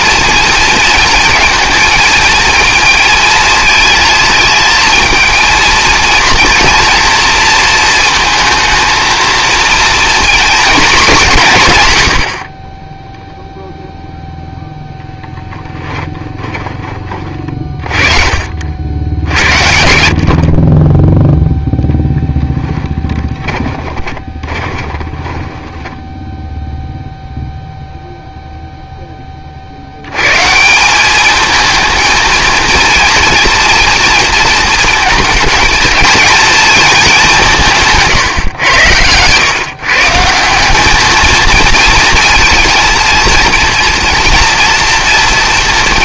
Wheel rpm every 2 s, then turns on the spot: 230, 230, 230, 230, 220, 210, 20, 0, 30, 60, 20, 20, 20, 0, 10, 180, 230, 230, 210, 100, 200, 230, 240.
22-26